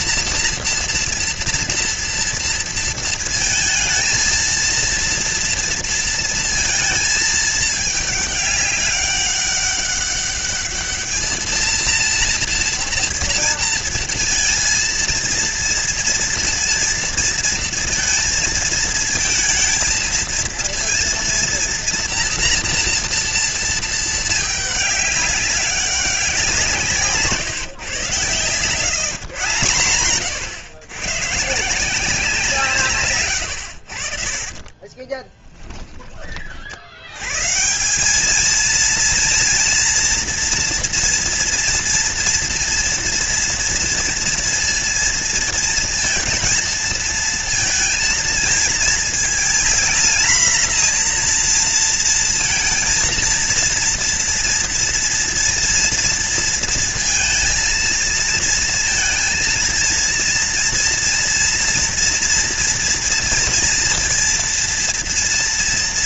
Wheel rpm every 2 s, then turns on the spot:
230, 230, 230, 230, 200, 210, 230, 230, 230, 230, 230, 230, 210, 180, 120, 130, 170, 50, 40, 220, 240, 230, 230, 230, 230, 230, 230, 230, 230, 230, 230, 230, 230.
28-30 34-36